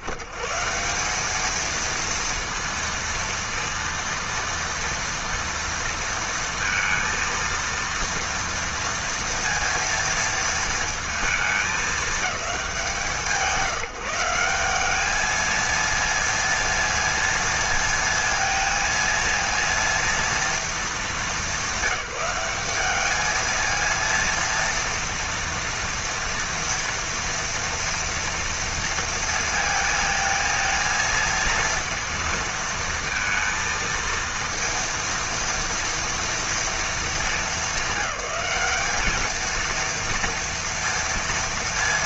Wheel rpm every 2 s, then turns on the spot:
150, 230, 230, 230, 230, 230, 200, 190, 230, 230, 220, 190, 230, 230, 230, 220, 230, 230, 230, 210, 230.
none